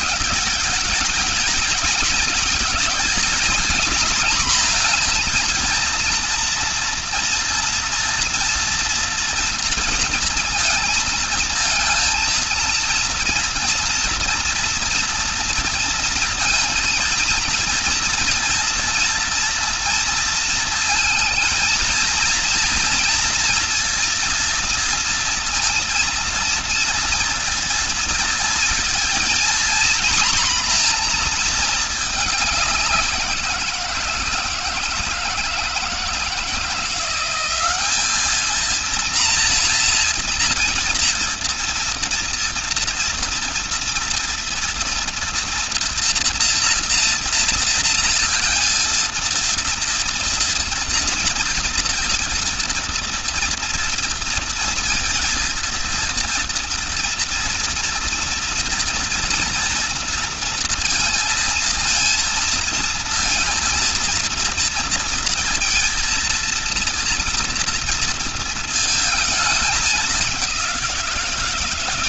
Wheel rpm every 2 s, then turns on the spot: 200, 220, 230, 230, 230, 230, 230, 230, 230, 230, 230, 230, 230, 230, 230, 240, 180, 160, 170, 220, 230, 230, 230, 230, 230, 240, 230, 230, 230, 240, 230, 230, 230, 230, 230, 190.
none